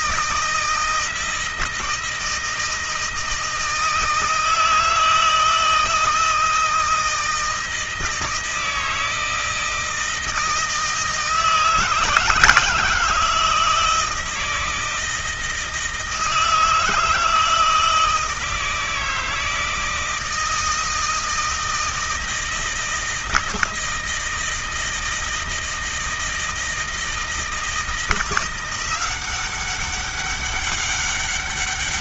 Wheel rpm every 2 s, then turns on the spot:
160, 160, 160, 160, 160, 160, 160, 160, 160, 160, 160, 160, 160, 160, 180, 200.
none